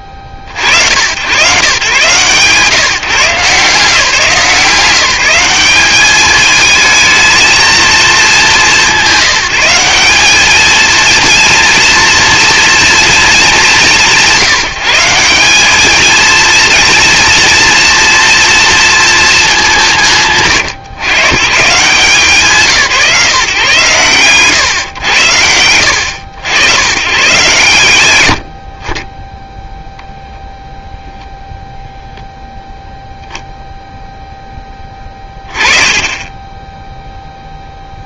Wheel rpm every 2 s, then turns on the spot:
60, 160, 180, 220, 180, 220, 230, 170, 230, 230, 120, 160, 110, 90, 60, 0, 0, 20, 10.
none